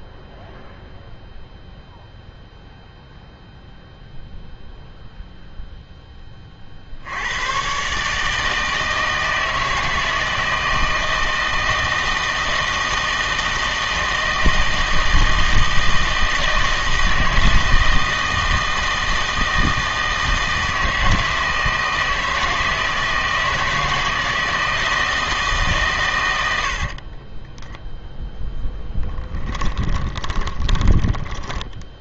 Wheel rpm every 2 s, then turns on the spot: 0, 0, 0, 40, 160, 160, 160, 160, 160, 160, 160, 160, 160, 70, 0, 20.
26-28 30-32